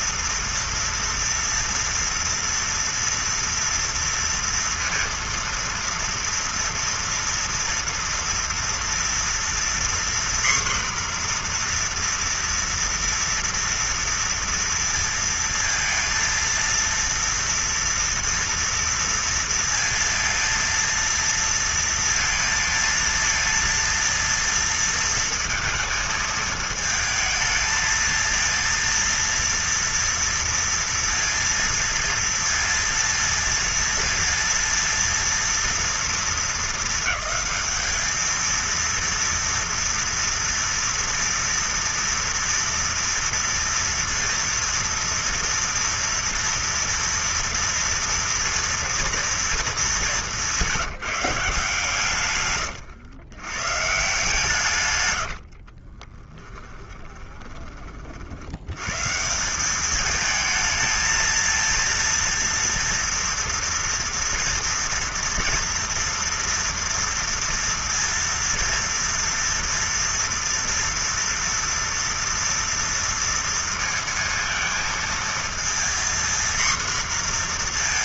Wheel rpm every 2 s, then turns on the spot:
230, 230, 230, 230, 230, 250, 240, 230, 230, 230, 230, 230, 230, 220, 230, 230, 230, 230, 230, 220, 230, 230, 230, 230, 230, 200, 130, 140, 20, 60, 220, 230, 230, 230, 230, 230, 230, 230, 240.
56-58